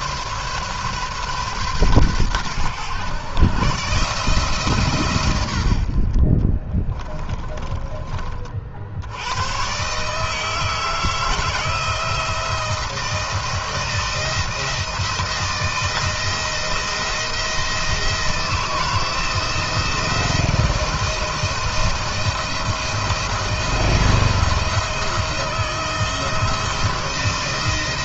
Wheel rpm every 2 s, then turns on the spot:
140, 110, 150, 40, 50, 160, 160, 170, 170, 160, 170, 170, 170, 170.
6-8